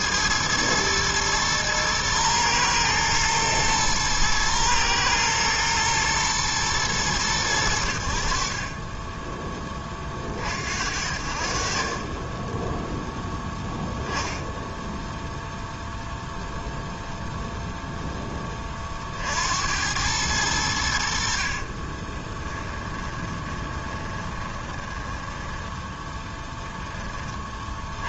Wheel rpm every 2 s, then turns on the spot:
110, 110, 120, 110, 40, 40, 10, 0, 0, 20, 90, 20, 20, 10.
8-10 22-26